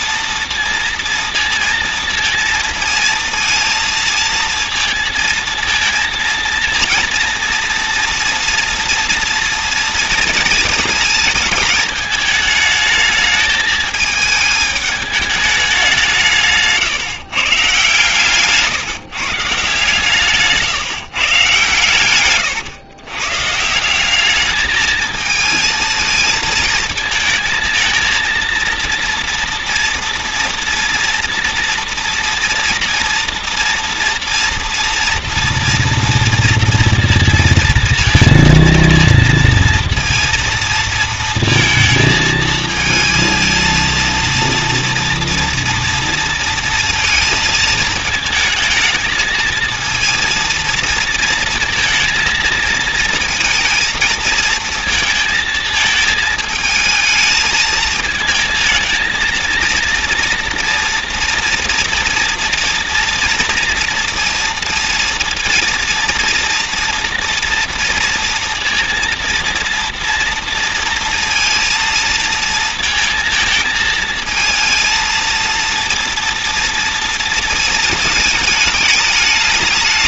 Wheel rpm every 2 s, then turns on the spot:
230, 230, 230, 230, 230, 230, 220, 220, 160, 140, 140, 130, 220, 220, 230, 230, 230, 230, 230, 230, 230, 220, 230, 230, 220, 230, 230, 230, 220, 220, 230, 230, 230, 230, 230, 230, 230, 220, 240, 210.
16-18